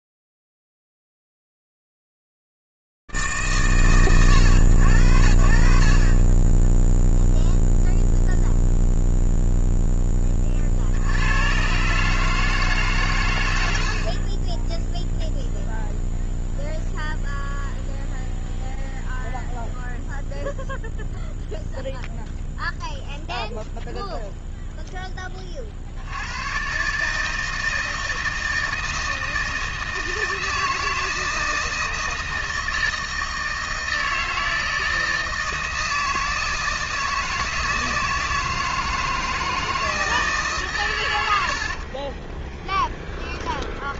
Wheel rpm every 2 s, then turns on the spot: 0, 40, 150, 50, 0, 0, 130, 80, 0, 0, 0, 0, 0, 80, 160, 160, 160, 160, 160, 160, 100, 10.
42-44